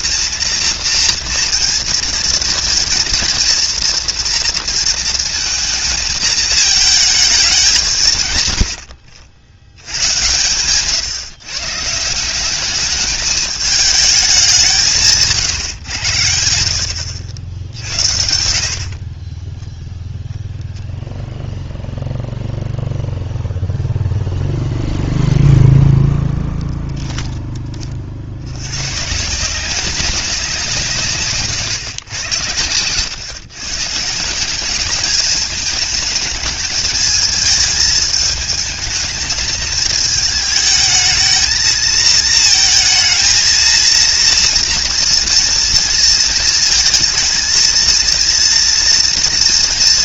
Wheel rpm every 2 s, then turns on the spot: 230, 230, 230, 220, 140, 120, 190, 190, 80, 70, 0, 0, 0, 0, 100, 180, 100, 190, 220, 220, 220, 230, 230, 220, 230.
18-20